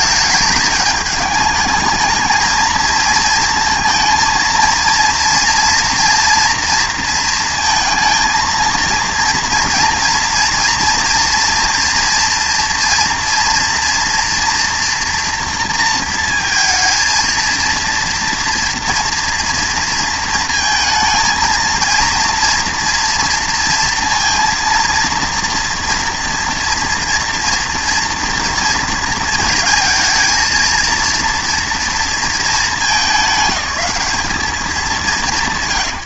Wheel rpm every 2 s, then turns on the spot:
210, 230, 230, 240, 230, 230, 230, 240, 230, 230, 230, 230, 230, 230, 240, 230, 220, 210.
none